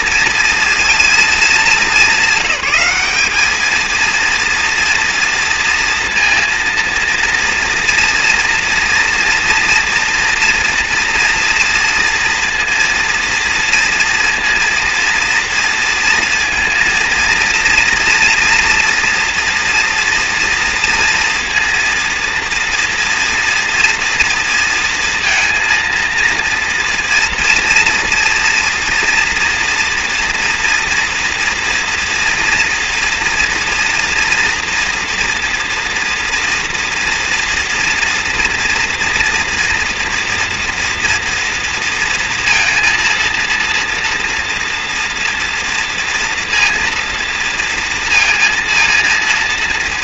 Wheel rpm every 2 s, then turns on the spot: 230, 200, 230, 230, 240, 230, 230, 230, 230, 230, 230, 230, 230, 230, 230, 240, 240, 230, 230, 230, 230, 230, 230, 230, 230.
none